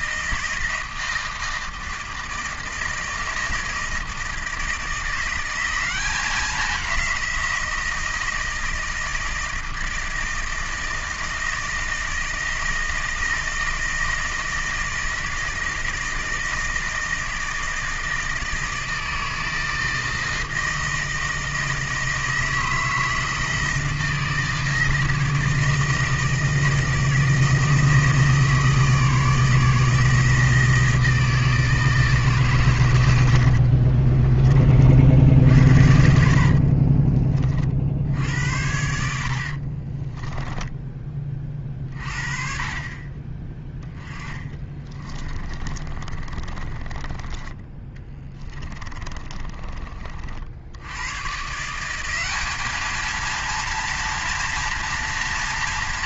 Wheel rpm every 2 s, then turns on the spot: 160, 160, 160, 190, 160, 160, 160, 160, 160, 160, 160, 160, 160, 160, 160, 160, 130, 40, 50, 80, 10, 40, 20, 30, 20, 70, 200, 230.
36-42 44-50